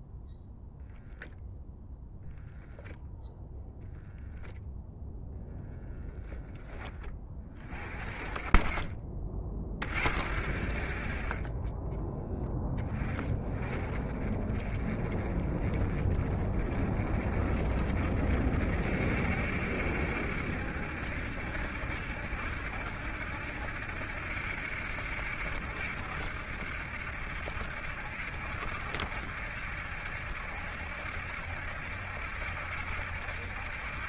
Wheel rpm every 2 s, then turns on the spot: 0, 0, 0, 20, 20, 50, 20, 30, 40, 60, 70, 70, 70, 80, 70, 70, 70.
none